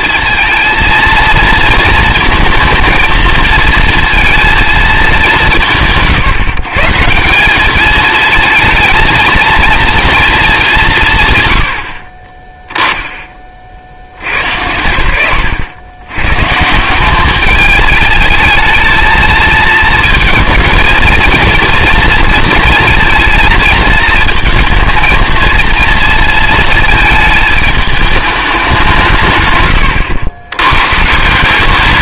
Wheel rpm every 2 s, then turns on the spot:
230, 220, 230, 150, 220, 210, 10, 90, 150, 220, 220, 230, 220, 230, 190, 110.
none